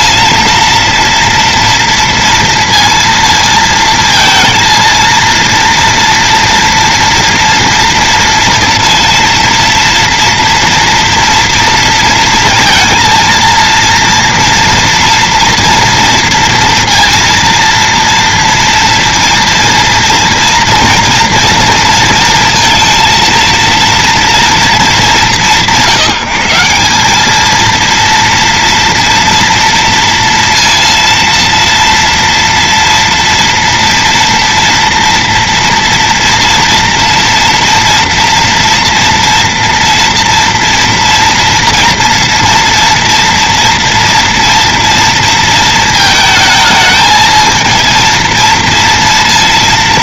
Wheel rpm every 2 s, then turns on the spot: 230, 230, 230, 230, 230, 230, 230, 230, 230, 230, 230, 230, 210, 190, 230, 230, 230, 230, 230, 230, 230, 230, 230, 220, 230.
none